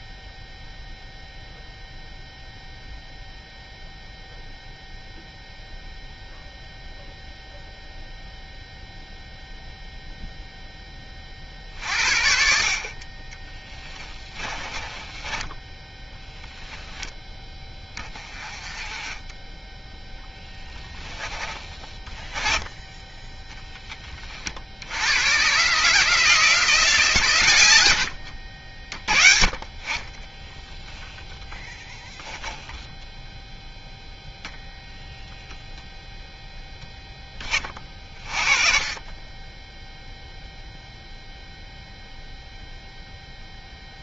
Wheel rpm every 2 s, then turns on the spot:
0, 0, 0, 0, 0, 30, 30, 20, 10, 20, 10, 20, 90, 140, 40, 10, 0, 0, 10, 20, 0, 0.
14-16 20-22 38-40